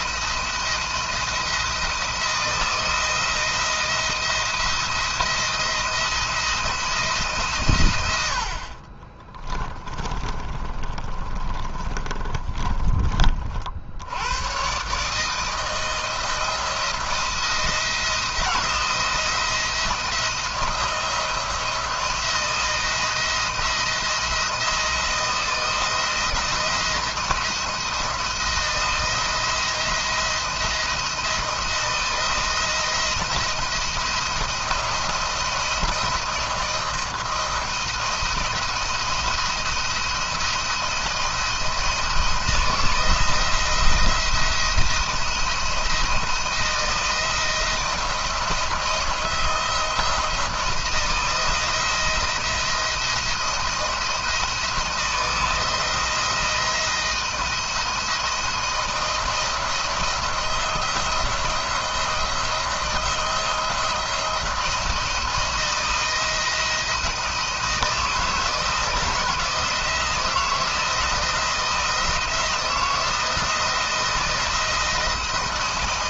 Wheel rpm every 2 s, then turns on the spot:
170, 160, 170, 160, 40, 30, 30, 120, 160, 170, 170, 170, 160, 170, 170, 160, 160, 170, 170, 170, 160, 170, 170, 170, 170, 170, 170, 160, 170, 170, 170, 170, 170, 170, 160, 160, 170, 170.
8-14